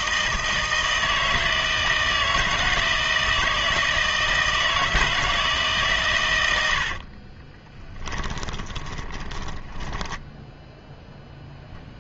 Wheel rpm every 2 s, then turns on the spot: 160, 160, 160, 80, 20, 0.
6-10